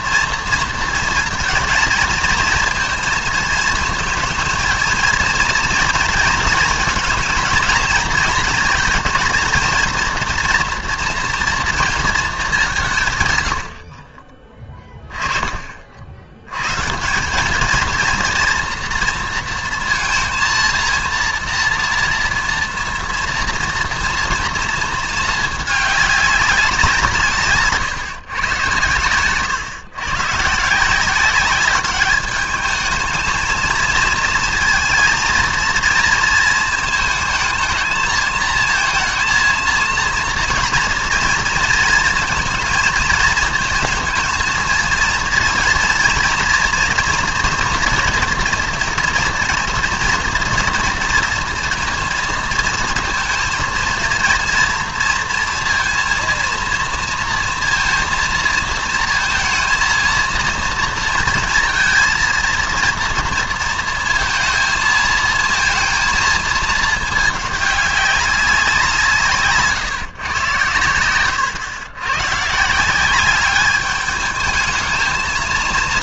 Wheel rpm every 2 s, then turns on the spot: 230, 230, 230, 230, 220, 230, 200, 20, 130, 230, 230, 230, 230, 180, 110, 160, 220, 230, 230, 230, 230, 230, 230, 230, 230, 230, 230, 230, 230, 230, 230, 230, 230, 220, 190, 110, 160, 220.
none